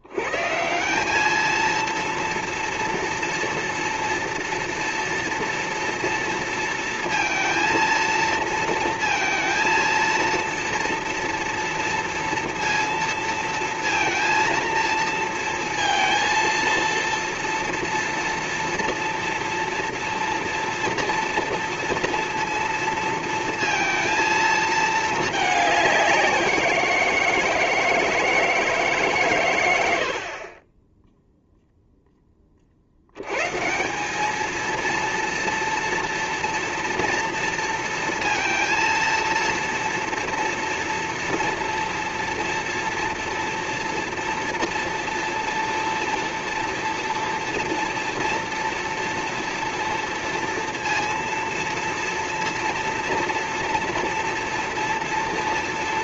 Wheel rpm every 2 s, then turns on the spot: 100, 230, 230, 230, 230, 230, 230, 230, 230, 230, 240, 230, 230, 180, 160, 50, 10, 210, 230, 230, 230, 230, 240, 230, 230, 230, 230, 230.
none